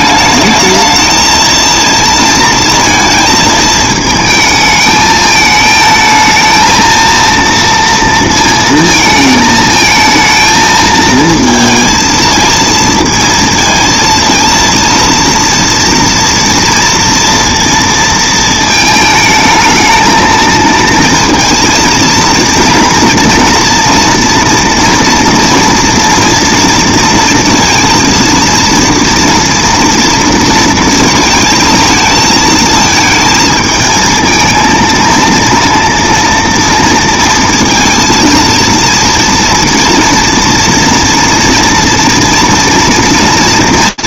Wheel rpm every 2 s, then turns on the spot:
220, 230, 220, 220, 230, 220, 230, 230, 230, 220, 230, 230, 230, 230, 230, 230, 220, 220, 230, 230, 230, 230.
none